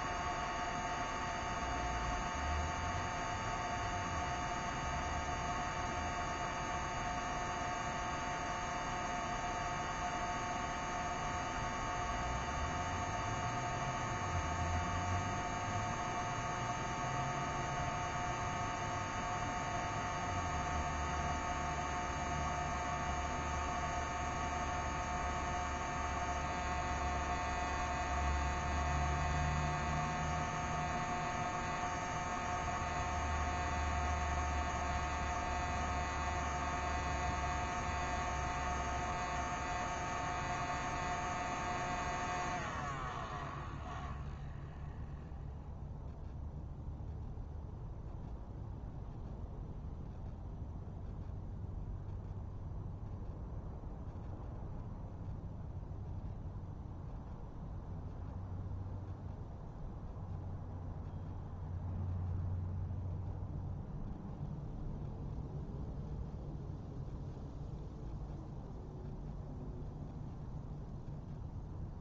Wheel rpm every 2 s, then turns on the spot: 0, 0, 0, 0, 0, 0, 0, 0, 0, 0, 0, 0, 0, 0, 0, 0, 0, 0, 0, 0, 0, 0, 0, 0, 0, 0, 0, 0, 0, 0, 0, 0, 0, 0, 0, 0.
none